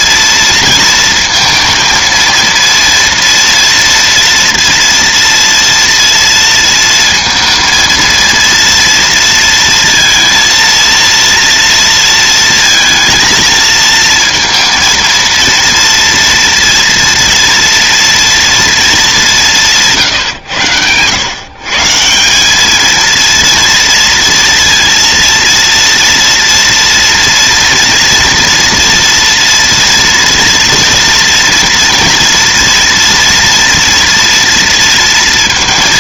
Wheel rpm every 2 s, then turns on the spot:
230, 230, 230, 230, 230, 230, 230, 230, 240, 230, 120, 200, 230, 230, 240, 230, 230, 230.
none